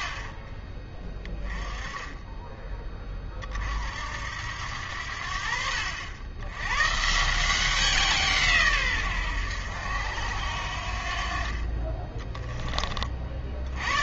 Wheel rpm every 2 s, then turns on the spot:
20, 20, 80, 120, 130, 80, 20.
none